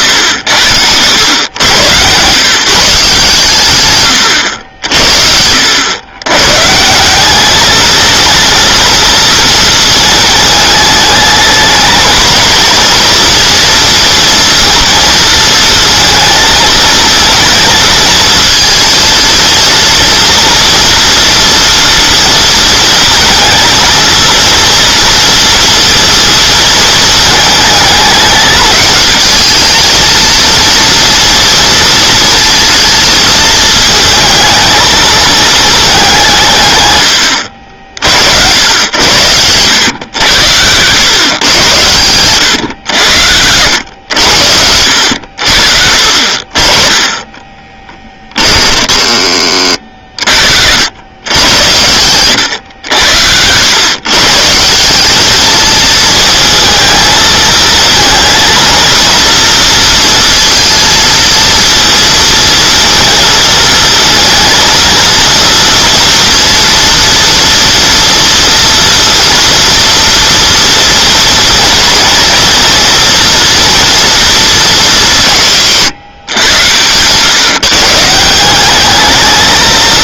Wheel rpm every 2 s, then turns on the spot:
90, 160, 80, 150, 230, 210, 230, 230, 220, 220, 230, 230, 230, 220, 210, 230, 220, 220, 130, 80, 100, 100, 80, 30, 20, 80, 90, 180, 220, 230, 230, 230, 230, 230, 230, 230, 230, 210, 120, 200.
48-50 76-78